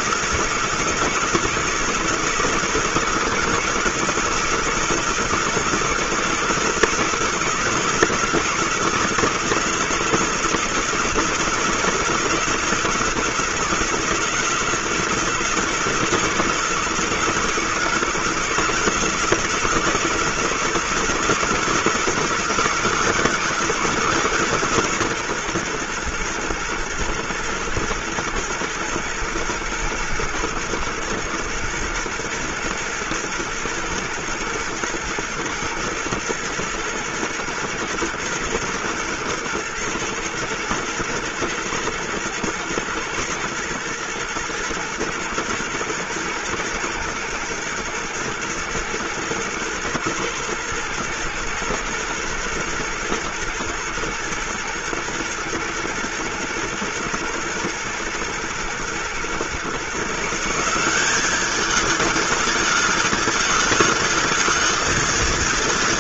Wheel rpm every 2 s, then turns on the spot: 160, 170, 160, 160, 160, 160, 160, 160, 160, 160, 160, 160, 140, 120, 120, 110, 110, 120, 120, 120, 120, 110, 120, 120, 120, 120, 110, 110, 110, 110, 180, 210, 220.
none